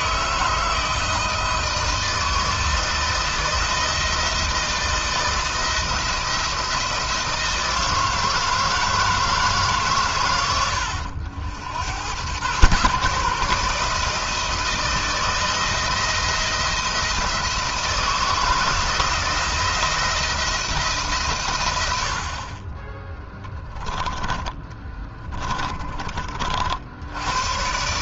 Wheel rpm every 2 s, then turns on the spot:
160, 160, 160, 170, 160, 100, 120, 160, 170, 160, 160, 30, 20, 50.
24-26